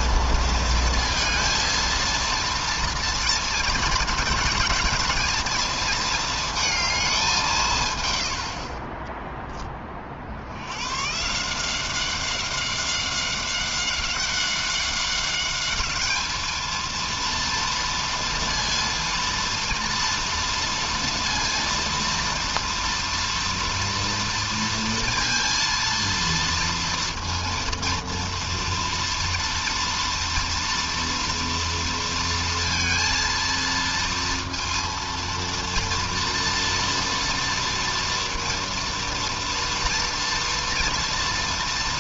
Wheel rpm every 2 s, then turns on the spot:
230, 230, 220, 220, 90, 70, 190, 190, 220, 230, 230, 230, 230, 230, 230, 230, 230, 230, 230, 230, 230.
8-10